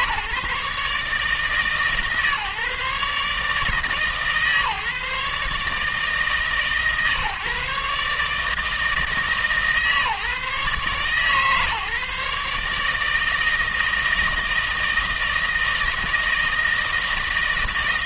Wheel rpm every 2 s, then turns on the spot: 150, 150, 150, 150, 150, 130, 150, 160, 160.
none